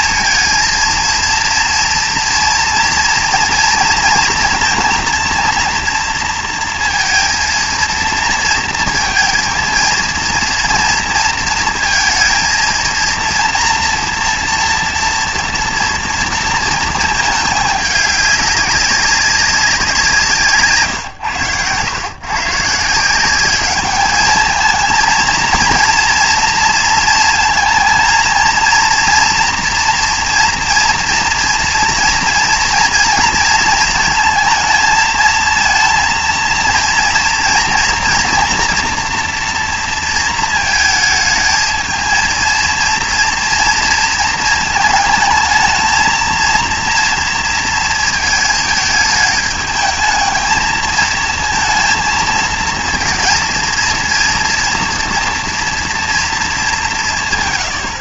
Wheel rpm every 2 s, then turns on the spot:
230, 230, 230, 230, 230, 230, 230, 230, 230, 200, 150, 160, 220, 230, 230, 230, 230, 220, 230, 230, 220, 230, 220, 230, 220, 220, 220, 230, 200.
none